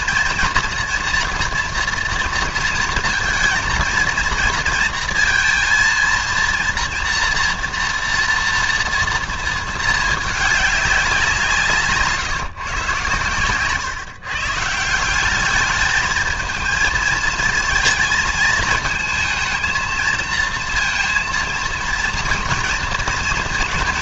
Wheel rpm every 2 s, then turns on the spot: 230, 230, 230, 230, 230, 200, 130, 150, 220, 230, 230, 230.
none